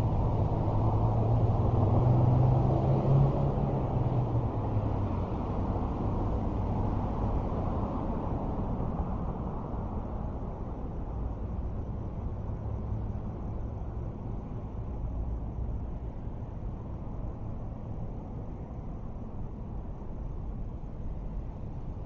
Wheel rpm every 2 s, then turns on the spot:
0, 0, 0, 0, 0, 0, 0, 0, 0, 0, 0.
none